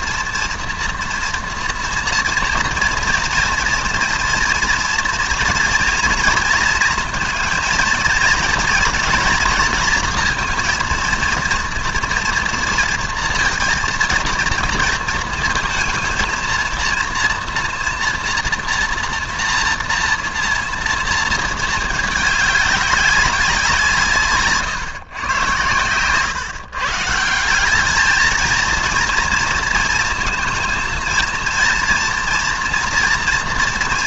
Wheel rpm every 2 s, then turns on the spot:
240, 230, 230, 230, 220, 230, 230, 230, 230, 230, 230, 200, 140, 130, 220, 230, 230.
none